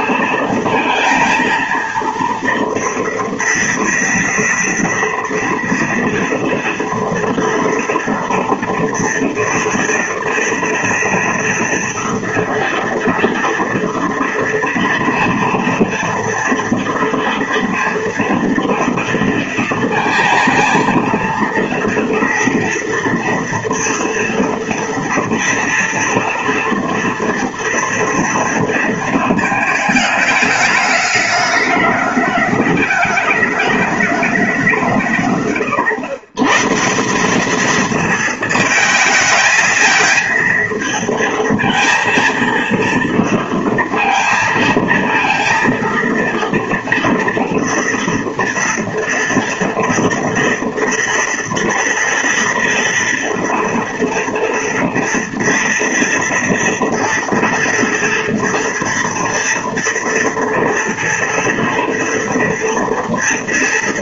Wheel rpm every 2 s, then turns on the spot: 230, 230, 230, 230, 230, 230, 230, 230, 230, 230, 220, 230, 230, 230, 230, 210, 210, 180, 140, 220, 220, 230, 230, 230, 230, 230, 230, 230, 230, 230, 230, 230.
none